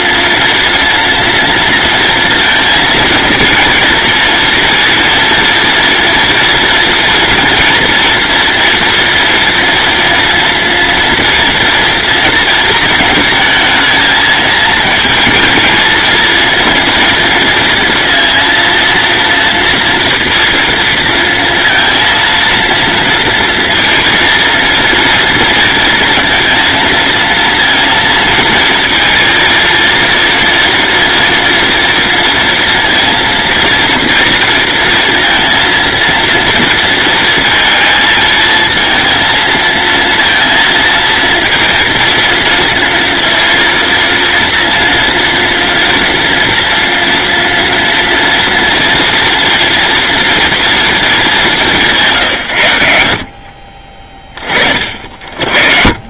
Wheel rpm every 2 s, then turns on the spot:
230, 230, 230, 240, 230, 230, 220, 220, 230, 230, 230, 230, 230, 230, 230, 230, 230, 230, 230, 230, 230, 230, 240, 230, 230, 230, 100, 50.
none